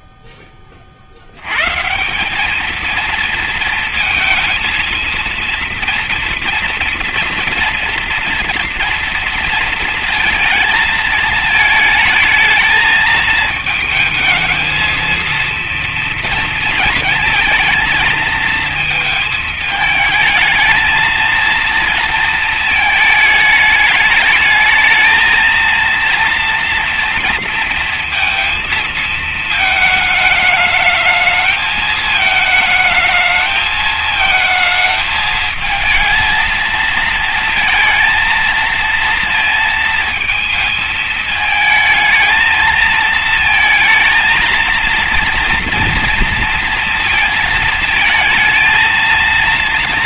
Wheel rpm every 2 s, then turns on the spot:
60, 220, 220, 230, 230, 220, 220, 220, 230, 220, 220, 220, 220, 230, 230, 220, 220, 220, 230, 230, 230, 220, 230, 230, 230.
none